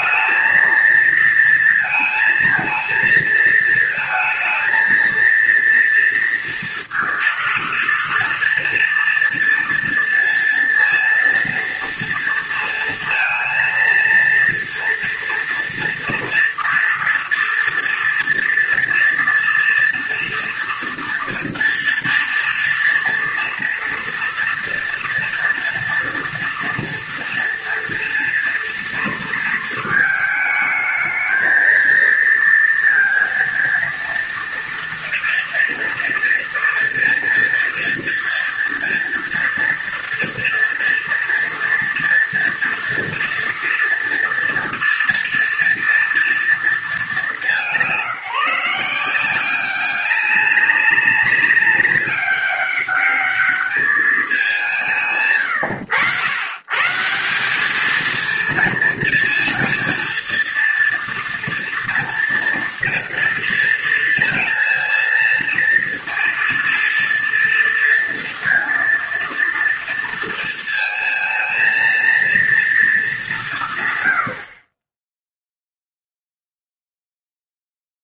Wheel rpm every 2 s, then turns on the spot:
220, 230, 230, 230, 230, 230, 230, 230, 230, 230, 230, 230, 230, 230, 240, 220, 230, 230, 240, 240, 230, 230, 230, 210, 170, 200, 200, 170, 140, 230, 230, 230, 230, 230, 230, 230, 220, 40, 0.
none